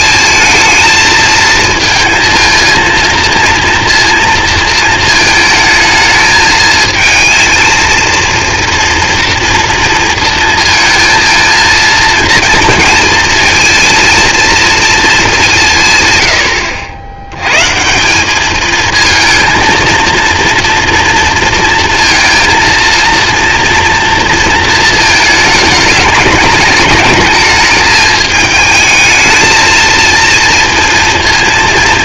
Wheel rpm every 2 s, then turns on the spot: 220, 230, 230, 220, 230, 220, 220, 230, 90, 220, 230, 230, 230, 210, 220, 230.
none